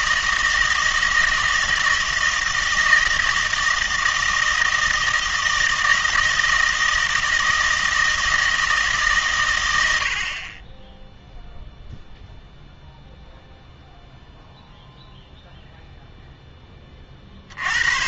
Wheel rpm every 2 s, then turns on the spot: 160, 160, 160, 160, 160, 20, 0, 0, 20.
none